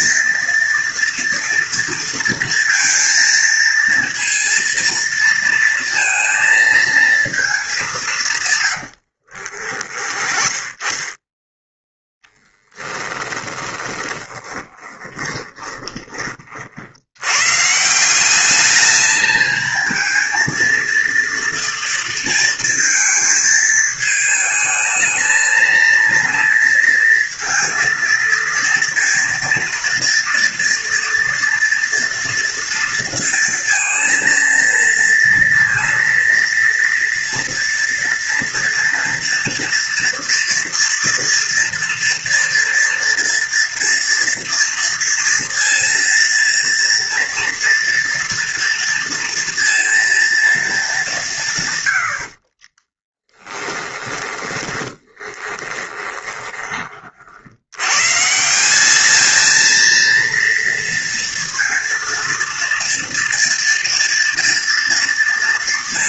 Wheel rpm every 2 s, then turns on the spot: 230, 230, 230, 230, 140, 20, 10, 20, 40, 200, 220, 230, 220, 230, 230, 230, 230, 230, 240, 230, 230, 230, 230, 230, 230, 220, 50, 20, 20, 170, 230, 230, 230.
8-10 12-16 52-58